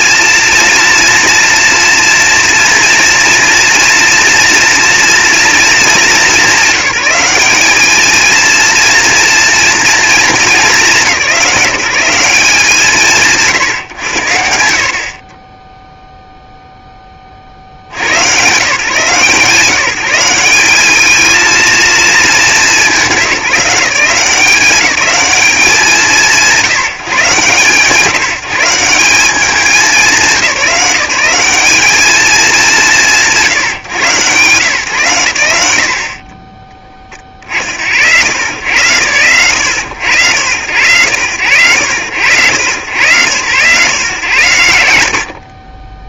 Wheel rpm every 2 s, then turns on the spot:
230, 230, 230, 190, 230, 190, 120, 30, 20, 160, 220, 180, 190, 150, 170, 180, 160, 110, 30, 100, 100, 110, 70.
none